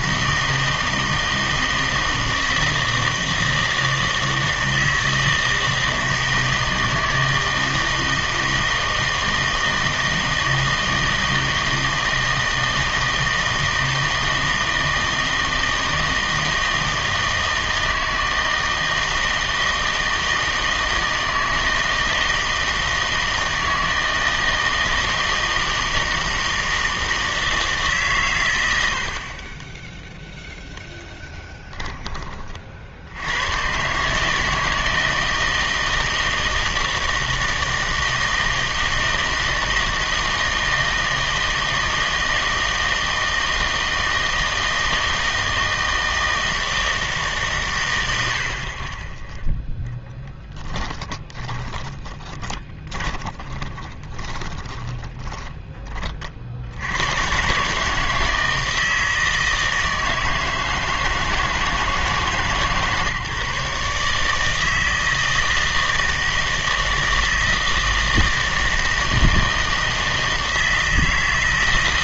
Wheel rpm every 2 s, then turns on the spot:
160, 160, 160, 160, 160, 160, 160, 160, 160, 160, 160, 160, 160, 160, 100, 0, 50, 160, 160, 160, 160, 160, 160, 160, 50, 20, 20, 10, 80, 160, 160, 150, 160, 160, 160, 160.
50-56